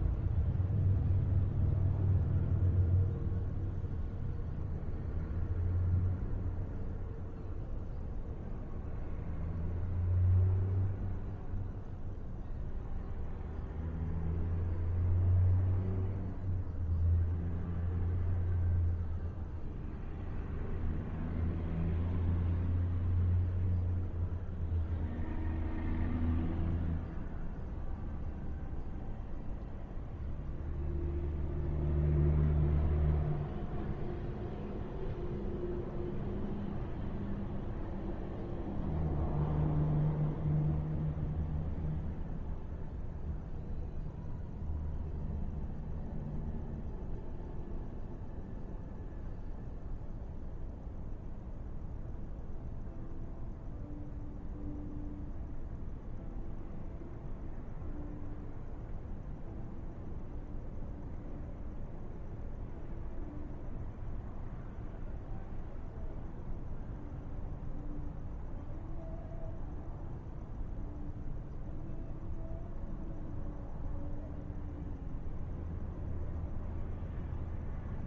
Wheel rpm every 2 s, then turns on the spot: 0, 0, 0, 0, 0, 0, 0, 0, 0, 0, 0, 0, 0, 0, 0, 0, 0, 0, 0, 0, 0, 0, 0, 0, 0, 0, 0, 0, 0, 0, 0, 0, 0, 0, 0, 0, 0, 0, 0.
none